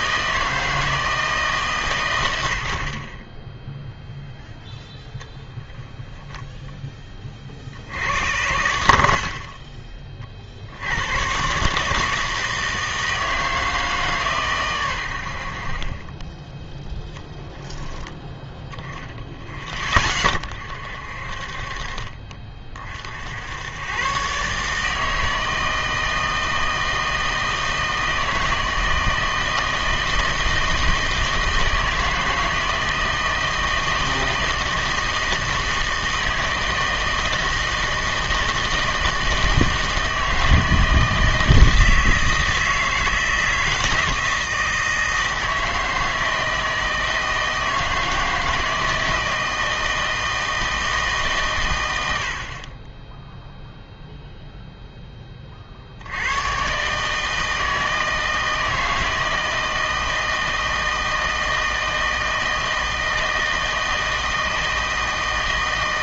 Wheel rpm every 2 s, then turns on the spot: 160, 70, 0, 10, 90, 60, 160, 130, 20, 10, 40, 40, 150, 160, 160, 160, 160, 160, 160, 160, 160, 160, 160, 160, 160, 160, 40, 0, 130, 160, 160, 160, 160.
16-18